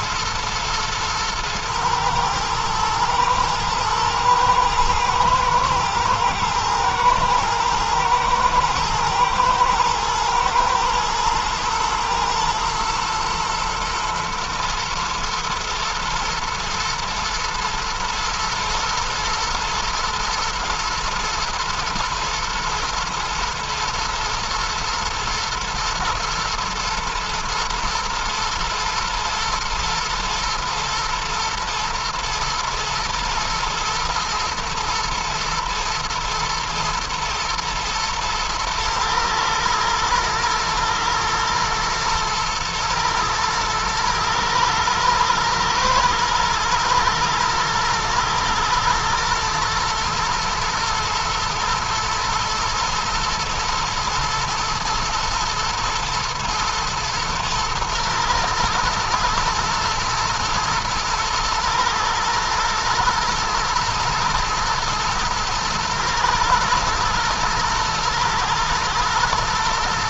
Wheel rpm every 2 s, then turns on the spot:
120, 110, 120, 110, 110, 120, 110, 110, 110, 120, 120, 120, 110, 110, 110, 110, 120, 120, 110, 110, 110, 110, 120, 110, 110, 120, 110, 120, 110, 120, 110, 120, 110, 110, 120.
none